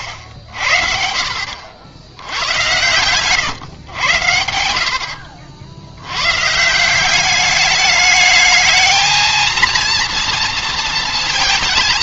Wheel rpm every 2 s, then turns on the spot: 50, 100, 80, 140, 220, 230.
none